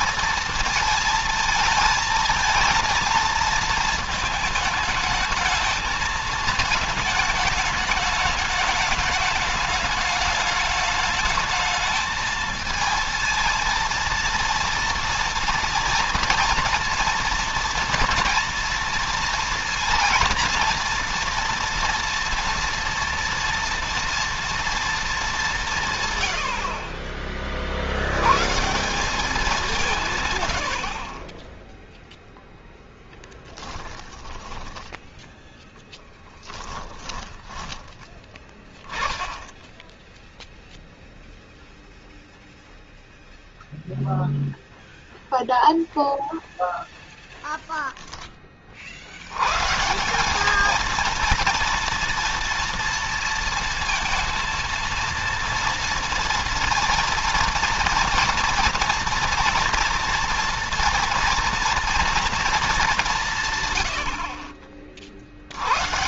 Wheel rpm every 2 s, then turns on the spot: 230, 220, 220, 220, 210, 210, 220, 230, 230, 240, 230, 230, 230, 100, 100, 140, 0, 10, 10, 20, 0, 0, 0, 0, 10, 190, 230, 230, 230, 240, 230, 230, 70.
34-38